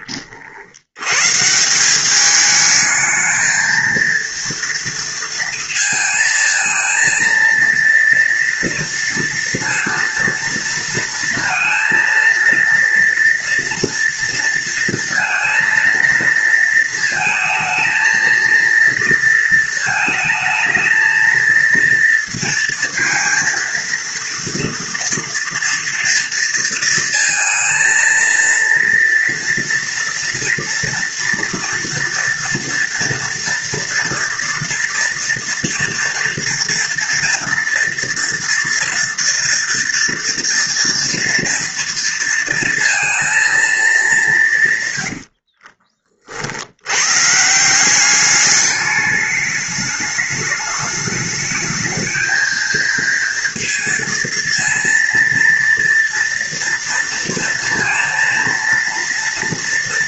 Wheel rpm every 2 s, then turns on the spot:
80, 220, 230, 230, 230, 230, 230, 230, 230, 230, 220, 230, 230, 230, 230, 230, 230, 230, 230, 240, 230, 230, 130, 100, 210, 210, 230, 230, 230, 230.
none